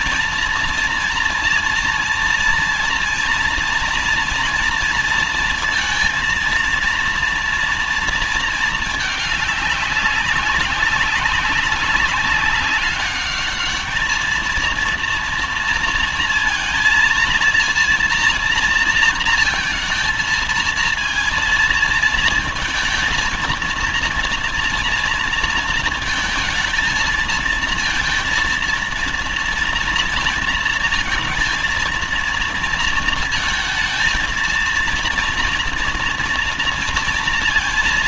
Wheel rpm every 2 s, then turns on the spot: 230, 230, 230, 230, 220, 190, 200, 220, 230, 230, 230, 220, 230, 230, 230, 230, 230, 230, 230.
none